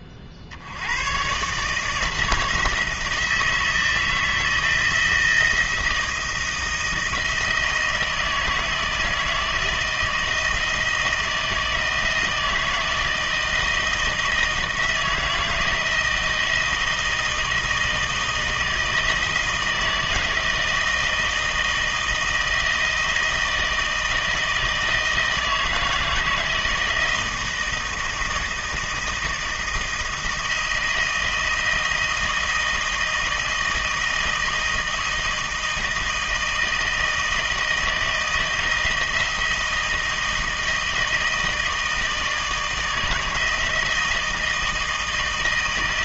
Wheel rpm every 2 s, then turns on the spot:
80, 160, 160, 170, 160, 160, 160, 160, 160, 160, 160, 160, 160, 160, 160, 170, 160, 160, 160, 160, 160, 160, 160.
none